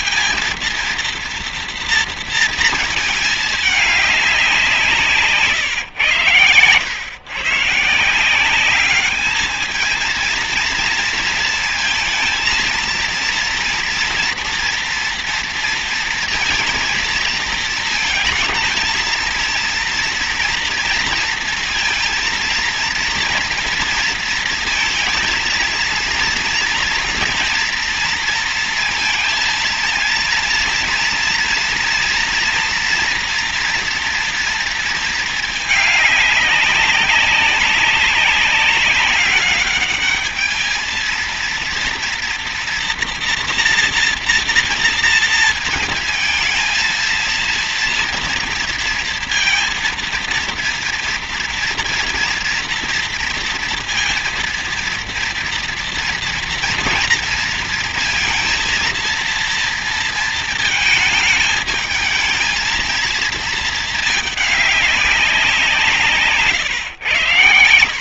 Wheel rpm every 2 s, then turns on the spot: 230, 220, 160, 120, 210, 230, 230, 230, 230, 230, 230, 230, 230, 230, 230, 230, 230, 220, 200, 190, 220, 240, 230, 230, 230, 230, 230, 230, 230, 230, 220, 230, 200, 120.
none